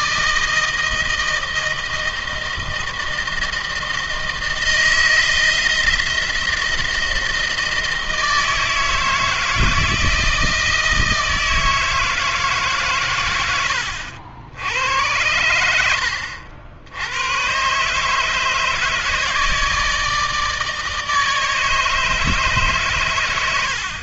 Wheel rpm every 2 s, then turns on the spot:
160, 160, 160, 160, 160, 160, 130, 90, 90, 150, 160, 130.
none